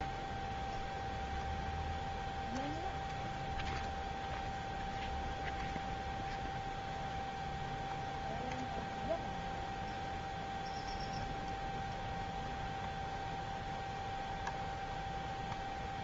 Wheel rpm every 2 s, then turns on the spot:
0, 0, 0, 0, 0, 0, 0, 0.
none